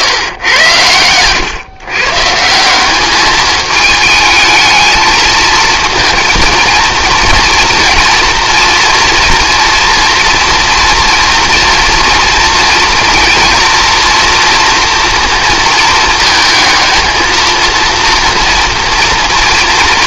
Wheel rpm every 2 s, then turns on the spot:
100, 190, 220, 230, 230, 230, 230, 230, 220, 230.
0-2